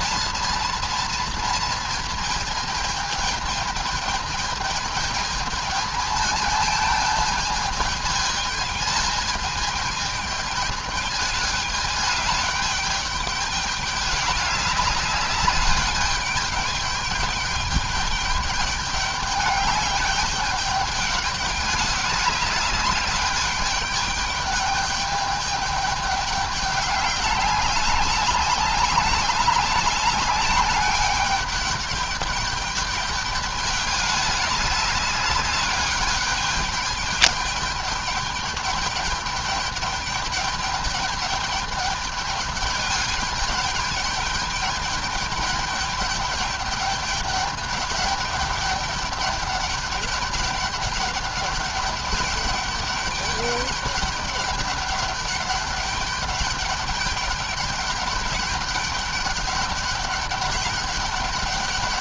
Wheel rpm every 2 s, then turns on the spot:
230, 220, 220, 220, 220, 210, 210, 200, 210, 200, 200, 200, 200, 200, 200, 200, 210, 210, 210, 210, 210, 210, 210, 200, 200, 200, 200, 200, 200, 200, 200.
none